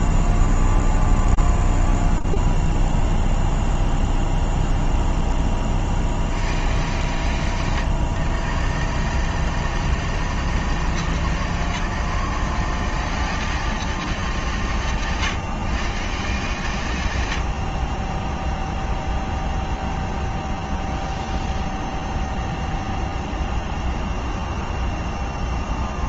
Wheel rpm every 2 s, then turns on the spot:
0, 0, 0, 30, 120, 150, 150, 200, 140, 20, 0, 0, 0.
none